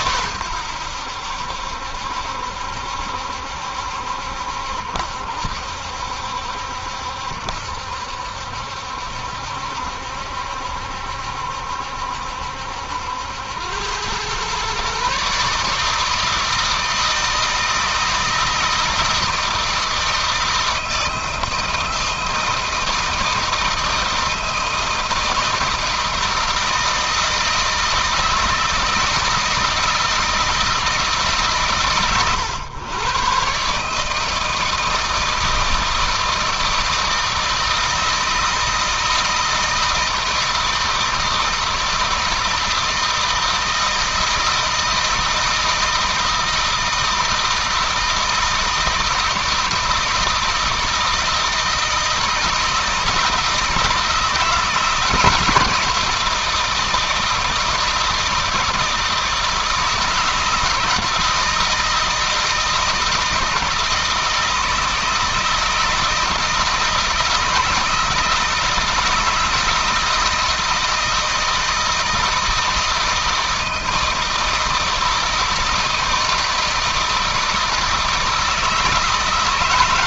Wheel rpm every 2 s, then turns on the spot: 90, 70, 70, 70, 70, 70, 70, 130, 160, 160, 160, 160, 160, 160, 160, 150, 110, 160, 160, 160, 160, 160, 160, 160, 160, 160, 160, 160, 160, 170, 170, 160, 160, 160, 160, 160, 160, 160, 160, 160.
none